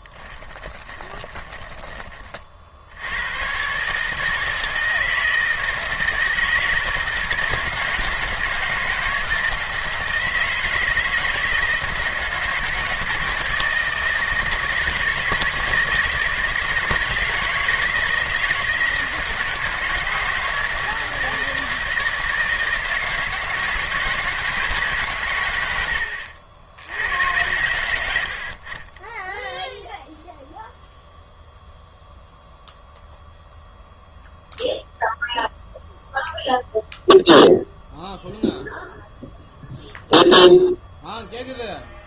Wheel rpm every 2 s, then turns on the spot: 20, 80, 160, 160, 170, 160, 150, 160, 160, 160, 160, 160, 140, 90, 20, 0, 0, 0, 0, 0, 0.
0-2